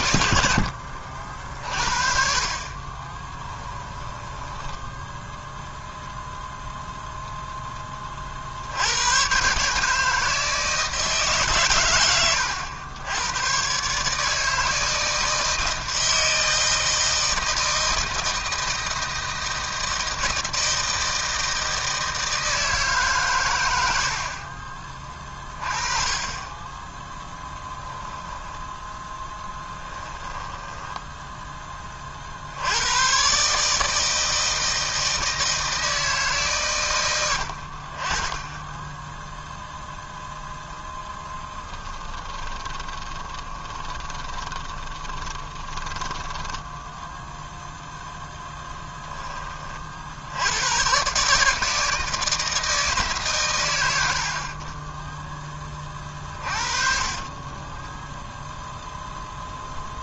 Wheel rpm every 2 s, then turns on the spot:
60, 30, 10, 0, 90, 160, 100, 160, 160, 160, 160, 150, 20, 10, 10, 10, 100, 160, 110, 10, 10, 20, 30, 0, 20, 110, 160, 30, 40, 0.
2-6 30-32 42-46 48-50 56-58